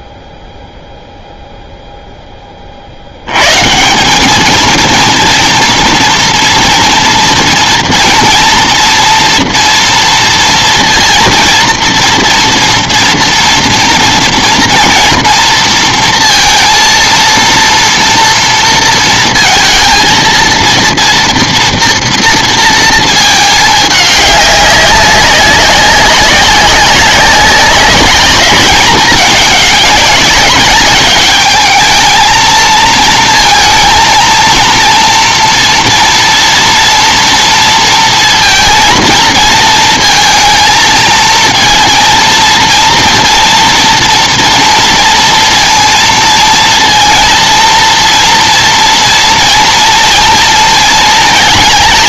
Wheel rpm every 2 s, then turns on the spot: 0, 140, 230, 230, 240, 230, 240, 230, 230, 220, 230, 210, 190, 190, 200, 210, 230, 230, 230, 230, 230, 230, 230, 230, 230, 220.
none